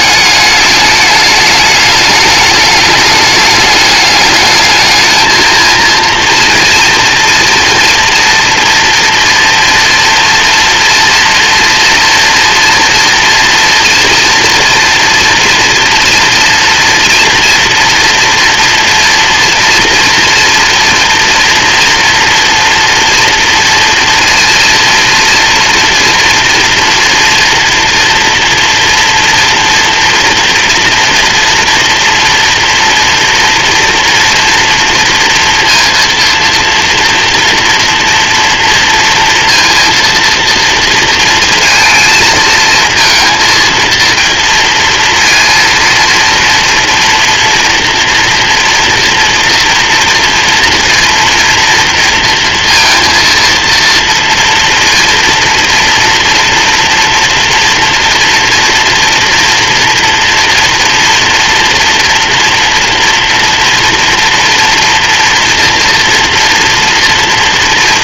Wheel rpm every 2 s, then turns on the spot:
210, 210, 220, 230, 230, 240, 230, 230, 230, 240, 230, 230, 230, 230, 230, 230, 230, 230, 240, 230, 230, 230, 230, 230, 240, 230, 230, 230, 240, 230, 230, 230, 240, 230.
none